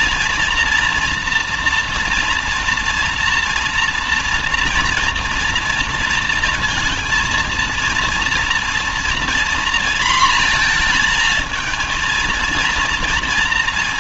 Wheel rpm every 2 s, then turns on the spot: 240, 240, 230, 230, 230, 230, 230.
none